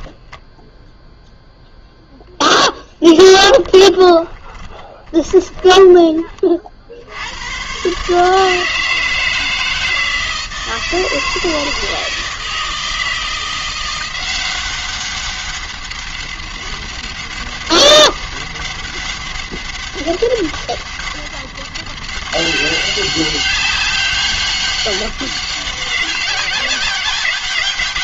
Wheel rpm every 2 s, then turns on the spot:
0, 10, 30, 40, 150, 160, 160, 180, 200, 200, 200, 200, 200, 190.
4-6